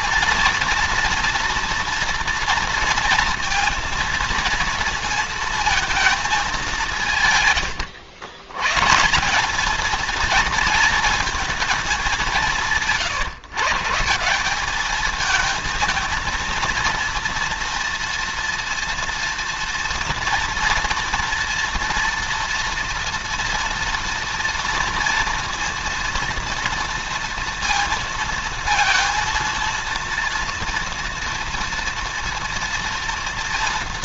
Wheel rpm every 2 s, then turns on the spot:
230, 230, 230, 170, 140, 230, 150, 200, 230, 230, 230, 230, 230, 230, 230, 230, 230.
none